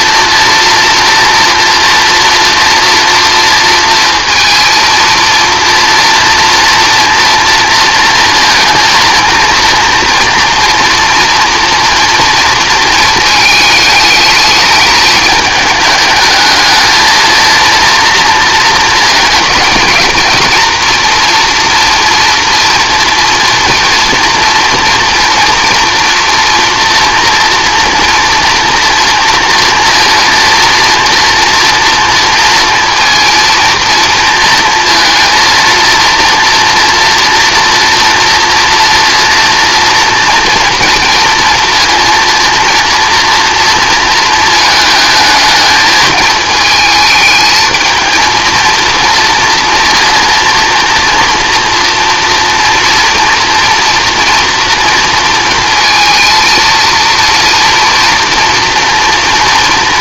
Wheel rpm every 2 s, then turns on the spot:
240, 240, 230, 230, 230, 230, 230, 210, 220, 220, 230, 240, 230, 240, 230, 230, 230, 230, 240, 230, 230, 230, 220, 220, 230, 230, 230, 230, 230, 230.
none